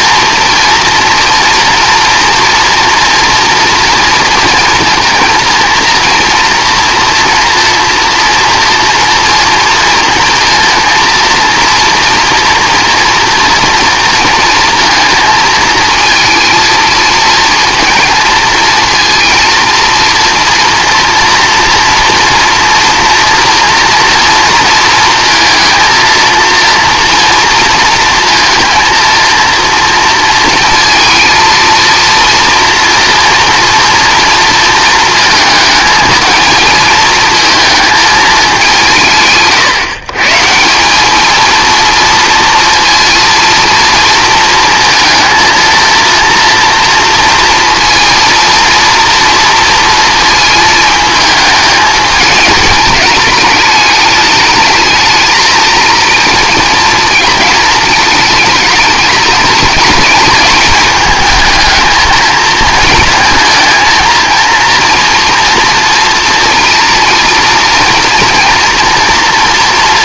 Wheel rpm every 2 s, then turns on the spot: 230, 230, 230, 230, 230, 230, 230, 230, 230, 230, 230, 230, 230, 230, 230, 220, 230, 230, 220, 200, 170, 230, 230, 230, 230, 220, 210, 210, 230, 220, 210, 220, 230, 230, 230.
none